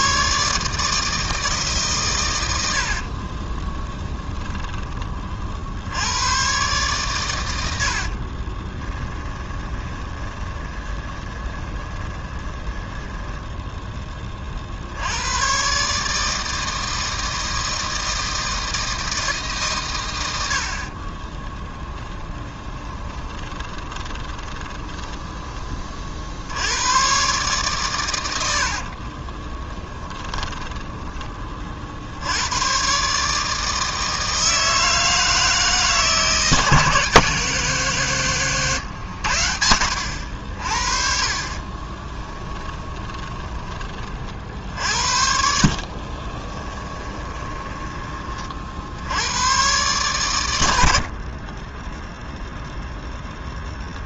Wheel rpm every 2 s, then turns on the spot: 150, 80, 20, 120, 20, 20, 10, 50, 160, 160, 70, 20, 20, 90, 80, 20, 100, 160, 160, 130, 60, 10, 60, 20, 60, 80, 0.
2-6 8-14 22-26 28-32 42-44 46-48